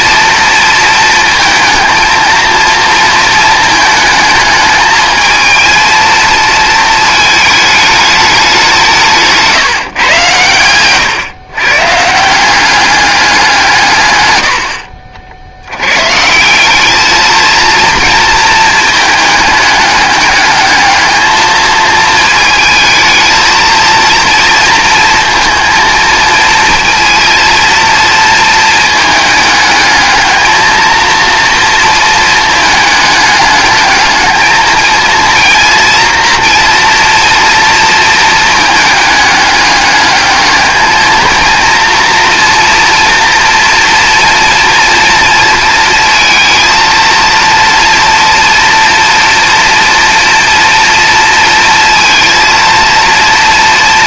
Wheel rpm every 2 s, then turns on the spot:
230, 230, 220, 220, 180, 110, 190, 70, 190, 220, 210, 220, 230, 230, 220, 230, 220, 220, 240, 220, 210, 230, 230, 230, 230, 230, 230.
none